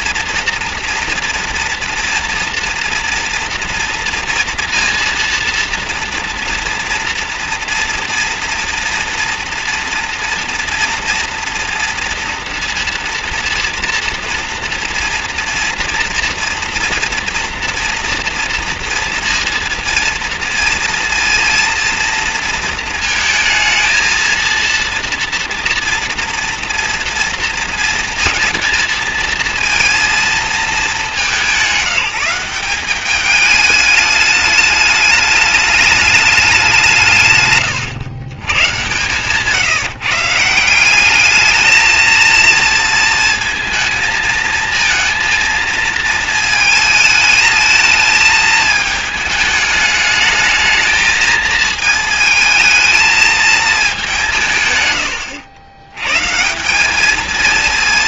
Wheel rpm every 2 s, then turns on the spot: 240, 230, 230, 230, 230, 240, 240, 230, 230, 230, 230, 230, 230, 230, 230, 210, 190, 210, 180, 140, 180, 230, 230, 220, 220, 220, 220, 120, 190.
none